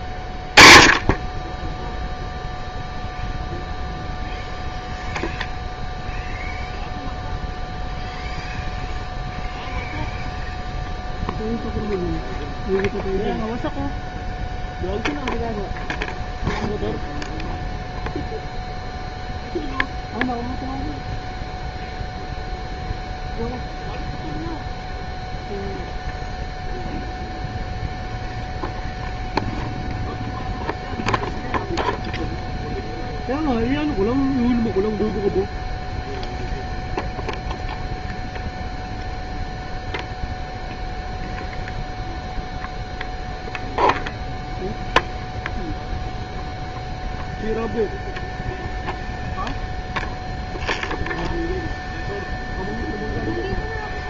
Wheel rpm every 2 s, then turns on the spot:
20, 0, 0, 0, 0, 0, 0, 0, 0, 0, 0, 0, 0, 0, 0, 0, 0, 0, 0, 0, 0, 0, 0, 0, 0, 0, 0.
none